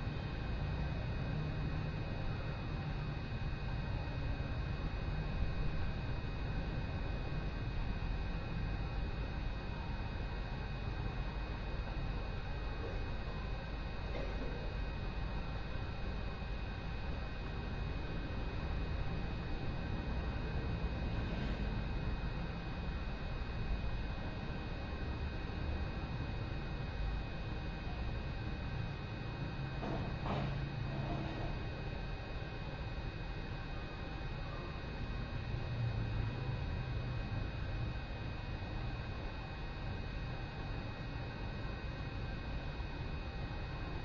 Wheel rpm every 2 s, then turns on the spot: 0, 0, 0, 0, 0, 0, 0, 0, 0, 0, 0, 0, 0, 0, 0, 0, 0, 0, 0, 0, 0, 0.
none